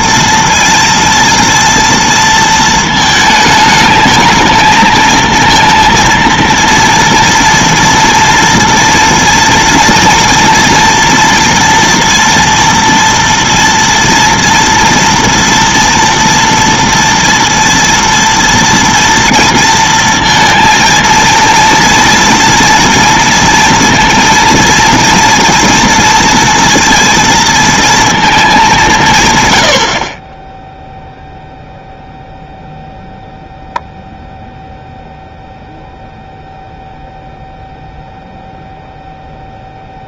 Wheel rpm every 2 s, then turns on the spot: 230, 220, 220, 230, 230, 230, 240, 230, 230, 230, 230, 230, 230, 230, 200, 10, 0, 0, 0, 0.
none